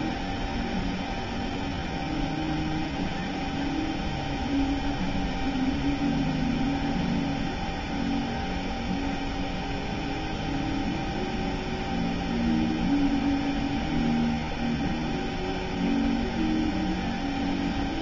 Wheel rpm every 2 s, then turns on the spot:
0, 0, 0, 0, 0, 0, 0, 0, 0.
none